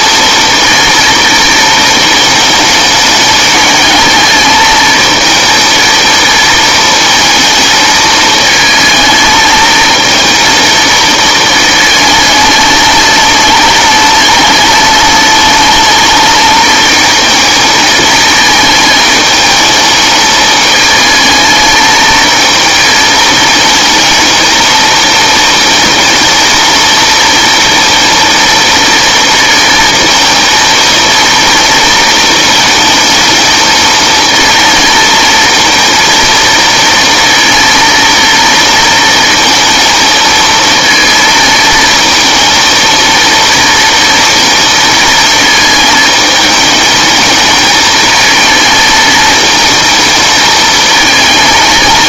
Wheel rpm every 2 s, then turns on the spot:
230, 220, 220, 220, 220, 230, 210, 210, 220, 220, 210, 230, 230, 230, 230, 230, 220, 220, 230, 230, 230, 220, 230, 210, 220, 220.
none